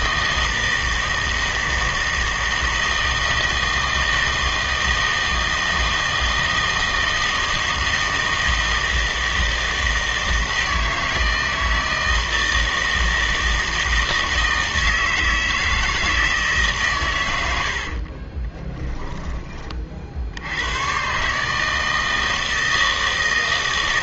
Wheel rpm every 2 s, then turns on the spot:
160, 160, 160, 160, 160, 160, 160, 160, 150, 20, 90, 160.
18-20